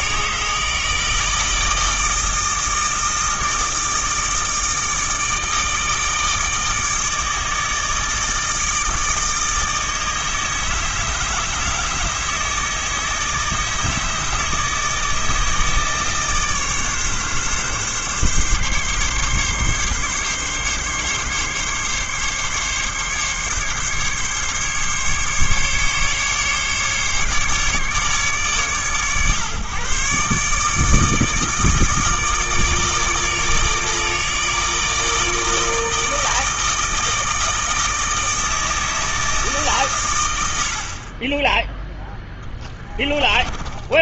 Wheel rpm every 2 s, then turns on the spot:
160, 160, 160, 160, 160, 150, 160, 160, 150, 140, 140, 140, 140, 140, 140, 150, 150, 160, 160, 160, 80, 10.
42-44